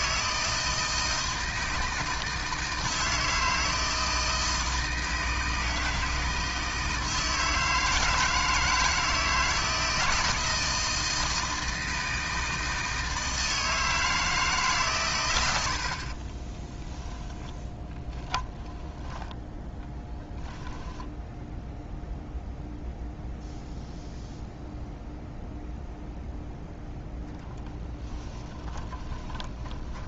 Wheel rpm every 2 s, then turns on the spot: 160, 160, 160, 160, 160, 160, 160, 130, 10, 10, 10, 0, 0, 10, 30.
18-22 28-30